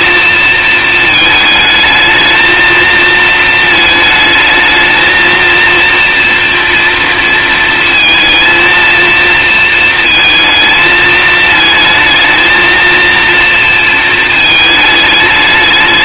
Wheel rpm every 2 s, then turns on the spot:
230, 220, 220, 230, 230, 220, 230, 220.
none